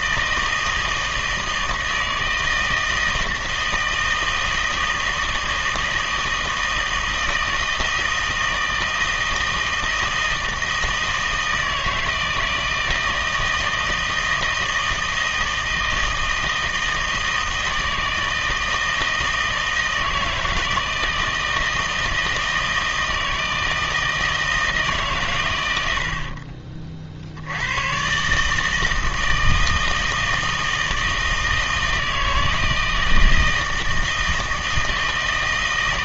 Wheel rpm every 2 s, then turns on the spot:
160, 160, 160, 160, 160, 160, 160, 160, 160, 160, 160, 160, 160, 50, 160, 160, 160, 160.
none